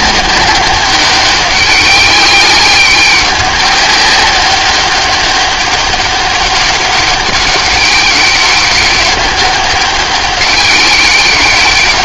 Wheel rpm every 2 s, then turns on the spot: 190, 200, 200, 200, 190, 190.
none